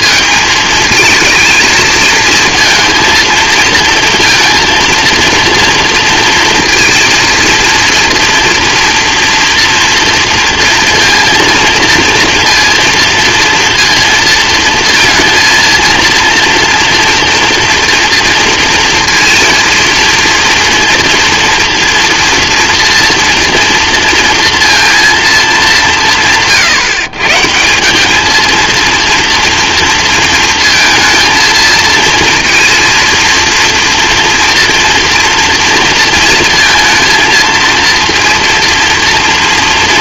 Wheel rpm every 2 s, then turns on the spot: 220, 230, 230, 230, 230, 230, 230, 230, 240, 230, 230, 230, 230, 150, 230, 230, 230, 230, 230, 230.
none